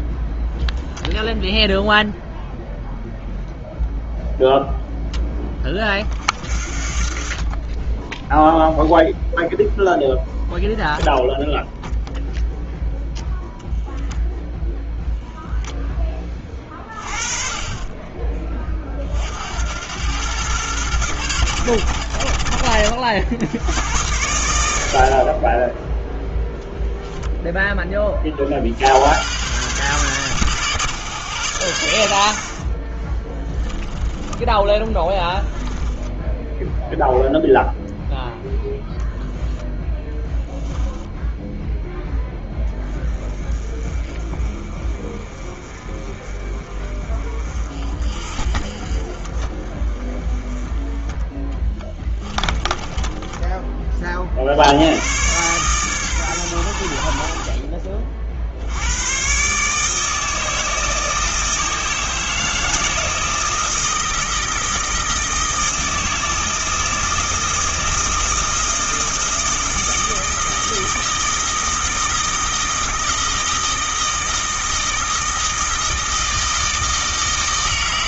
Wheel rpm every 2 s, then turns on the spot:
0, 0, 0, 50, 0, 0, 0, 0, 30, 20, 100, 50, 90, 0, 60, 130, 40, 20, 0, 0, 0, 10, 30, 30, 40, 20, 10, 70, 90, 70, 160, 160, 160, 160, 160, 160, 160, 160, 160.
34-36 52-54